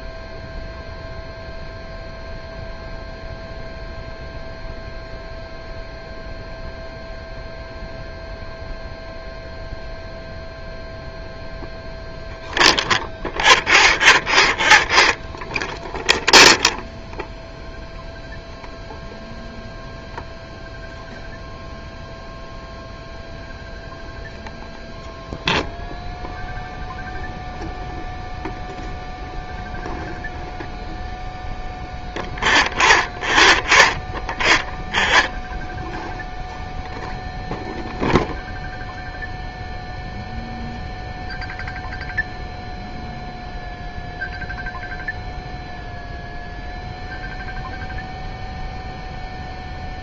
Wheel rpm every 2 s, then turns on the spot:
0, 0, 0, 0, 0, 0, 0, 0, 0, 0, 0, 0, 0, 0, 0, 0, 0, 0, 0, 0, 0, 0, 0, 0, 0.
none